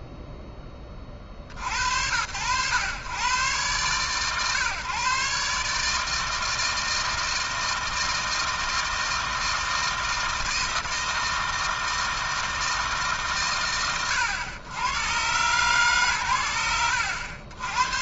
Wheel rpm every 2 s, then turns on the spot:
10, 100, 140, 160, 160, 160, 160, 120, 70.
none